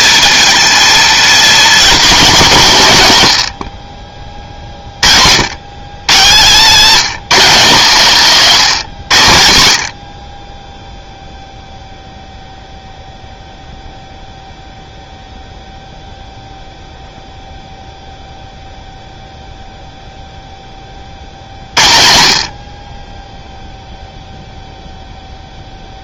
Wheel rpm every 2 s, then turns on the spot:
230, 200, 30, 170, 170, 20, 0, 0, 0, 0, 10, 50, 0.
none